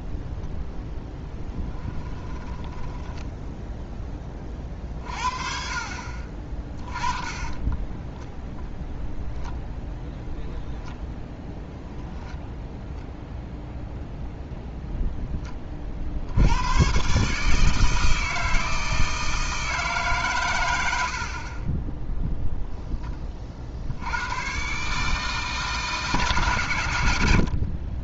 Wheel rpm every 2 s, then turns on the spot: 0, 10, 40, 30, 0, 0, 0, 0, 100, 160, 80, 0, 130, 110.
2-4 6-8